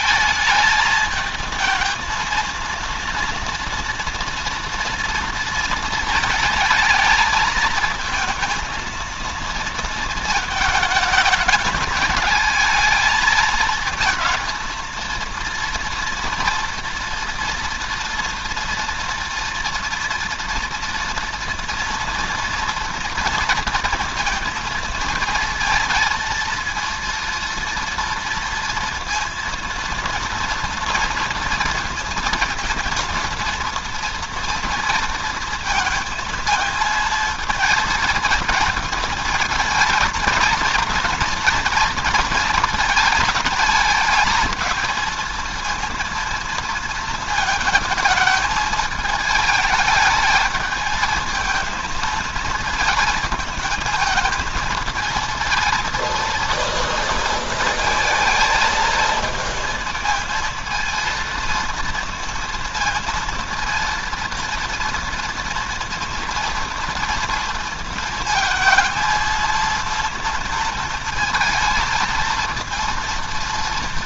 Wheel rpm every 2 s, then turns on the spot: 220, 230, 230, 220, 230, 220, 220, 230, 230, 230, 230, 230, 220, 230, 230, 230, 230, 230, 230, 230, 230, 220, 220, 230, 210, 220, 220, 220, 230, 230, 230, 230, 230, 230, 230, 230, 230.
none